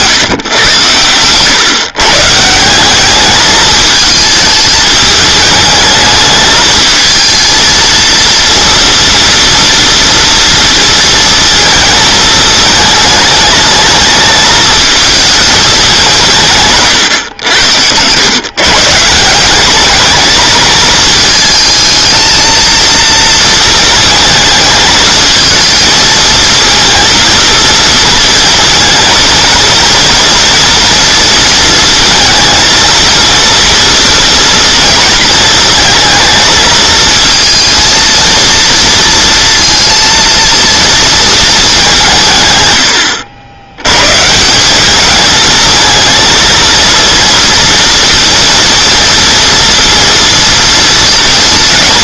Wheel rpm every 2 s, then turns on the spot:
110, 170, 210, 220, 230, 230, 220, 220, 140, 140, 220, 220, 220, 220, 230, 230, 230, 230, 220, 230, 230, 110, 190, 230, 240, 230.
none